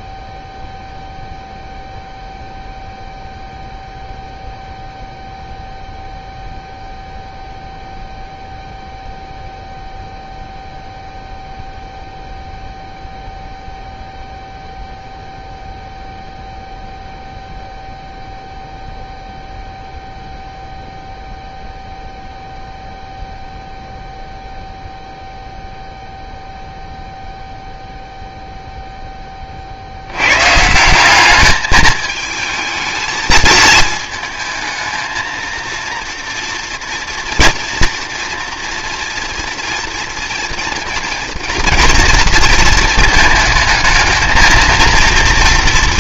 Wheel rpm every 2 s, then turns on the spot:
0, 0, 0, 0, 0, 0, 0, 0, 0, 0, 0, 0, 0, 0, 0, 150, 220, 220, 230, 240, 230, 230, 230.
none